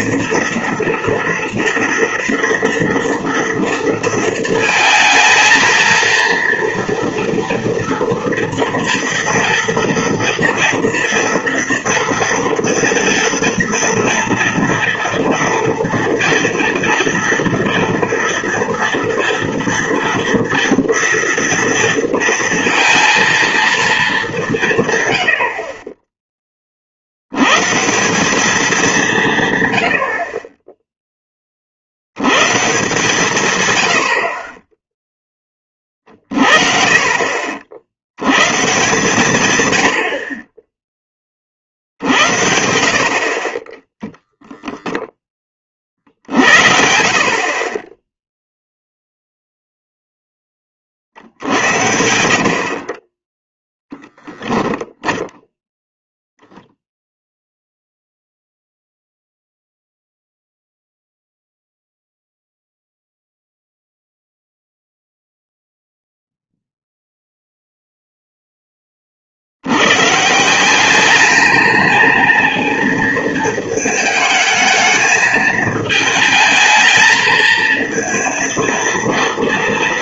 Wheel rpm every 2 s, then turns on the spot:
230, 230, 230, 230, 230, 240, 230, 230, 230, 230, 230, 230, 170, 30, 200, 20, 130, 20, 50, 130, 30, 70, 0, 50, 0, 20, 60, 0, 0, 0, 0, 0, 0, 0, 10, 180, 220, 220, 220, 230.
40-42 46-48 52-54